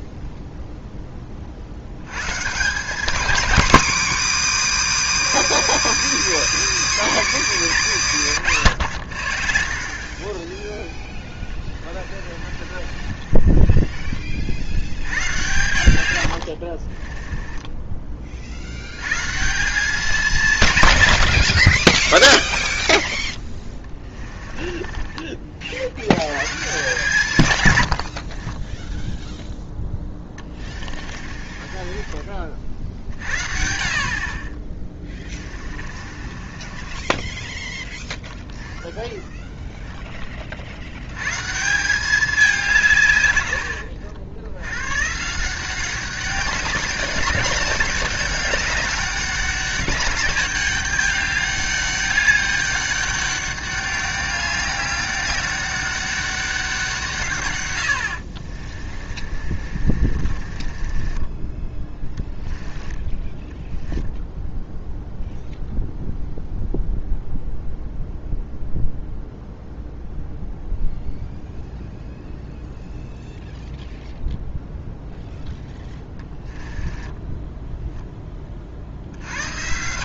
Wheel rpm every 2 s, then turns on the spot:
0, 180, 320, 320, 160, 10, 50, 90, 50, 70, 150, 30, 20, 150, 20, 30, 40, 30, 30, 0, 60, 180, 110, 200, 200, 200, 200, 200, 180, 40, 20, 10, 0, 0, 0, 0, 0, 0, 10, 50.
12-14 16-18 22-26 30-32 36-38 58-64 76-78